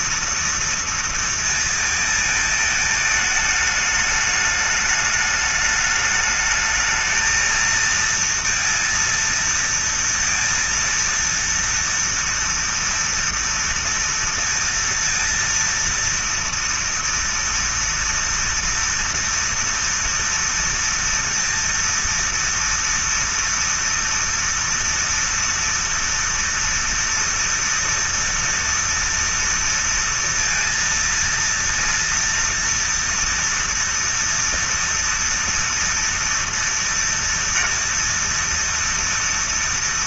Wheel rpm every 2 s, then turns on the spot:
230, 230, 210, 210, 230, 230, 230, 230, 230, 230, 230, 230, 230, 230, 230, 230, 230, 230, 240, 230.
none